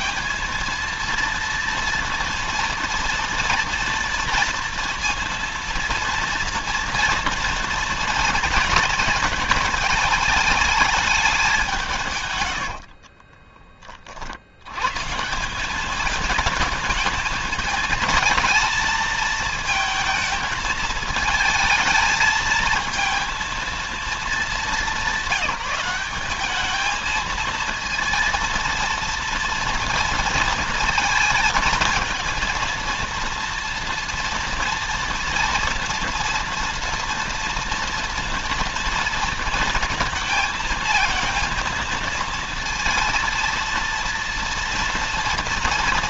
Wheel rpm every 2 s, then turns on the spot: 230, 230, 230, 240, 220, 210, 40, 150, 220, 220, 220, 220, 190, 220, 230, 230, 230, 230, 230, 230, 220, 230, 230.
12-14